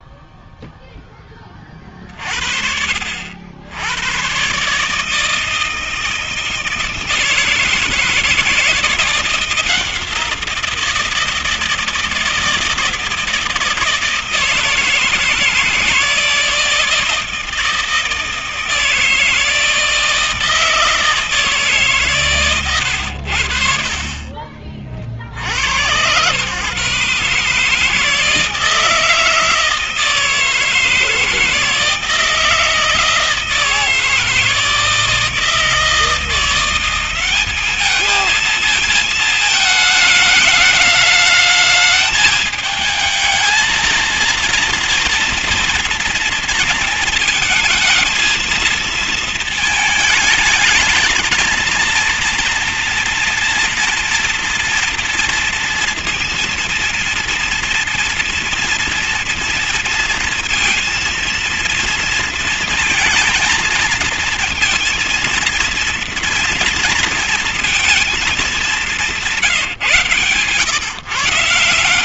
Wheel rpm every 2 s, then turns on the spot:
0, 50, 130, 160, 160, 170, 160, 160, 160, 160, 160, 120, 40, 130, 160, 160, 160, 160, 170, 220, 220, 210, 230, 230, 220, 210, 240, 230, 230, 230, 230, 230, 220, 230, 220, 130.
none